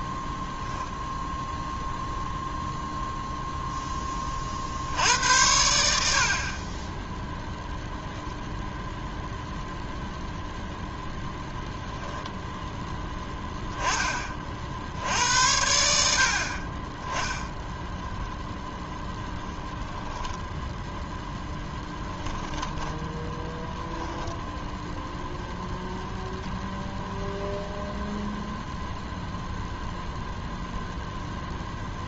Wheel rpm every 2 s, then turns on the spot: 0, 0, 60, 30, 0, 0, 0, 80, 30, 0, 0, 10, 0, 0, 0, 0.
22-24